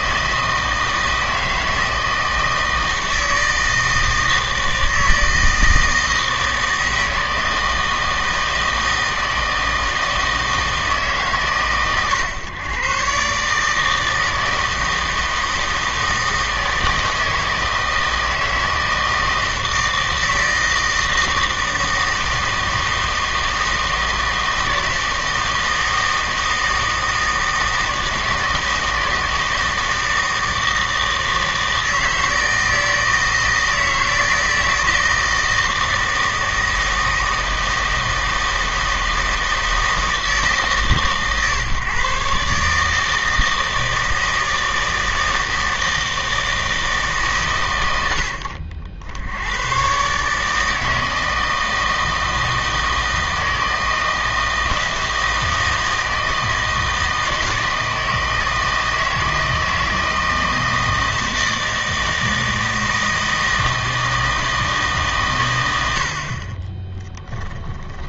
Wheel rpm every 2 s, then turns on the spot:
160, 160, 160, 160, 160, 160, 120, 160, 160, 160, 160, 160, 160, 160, 160, 160, 160, 160, 160, 160, 160, 140, 160, 160, 70, 150, 160, 160, 160, 160, 160, 160, 160, 40.
none